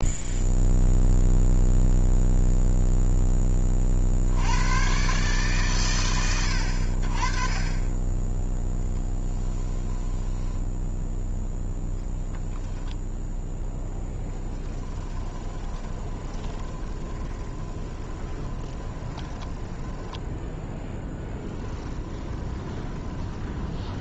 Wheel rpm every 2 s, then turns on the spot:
0, 0, 110, 70, 10, 10, 0, 10, 20, 20, 10, 20.
8-10 14-24